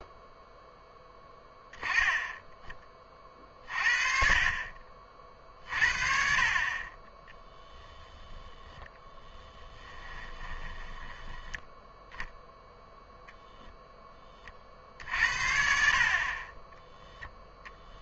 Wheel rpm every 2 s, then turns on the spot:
0, 20, 40, 40, 10, 10, 0, 50, 10.
8-12